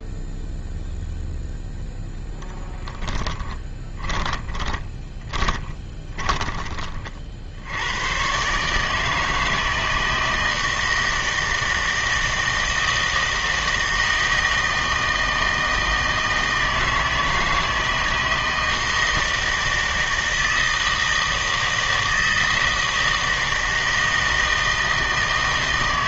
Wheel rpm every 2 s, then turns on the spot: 0, 10, 20, 30, 140, 160, 160, 160, 160, 160, 160, 160, 160.
4-6